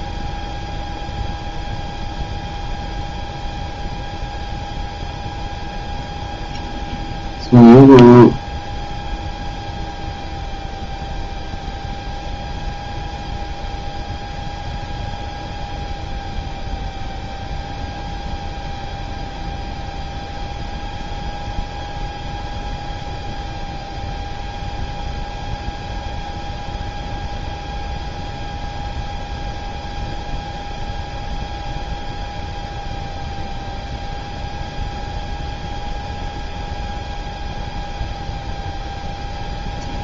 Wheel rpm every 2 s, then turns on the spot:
0, 0, 0, 0, 0, 0, 0, 0, 0, 0, 0, 0, 0, 0, 0, 0, 0, 0, 0, 0.
none